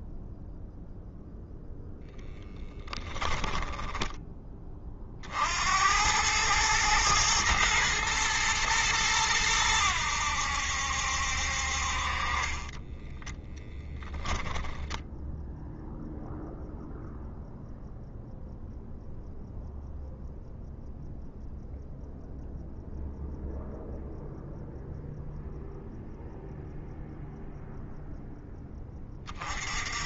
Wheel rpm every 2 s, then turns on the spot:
0, 10, 30, 110, 110, 70, 10, 0, 0, 0, 0, 0, 0, 0, 20.
2-4 12-14